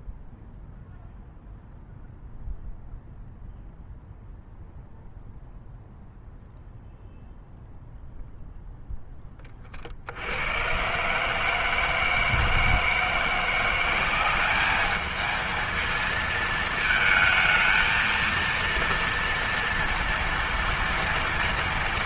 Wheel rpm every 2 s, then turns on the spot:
0, 0, 0, 0, 0, 90, 160, 200, 220, 230, 230.
none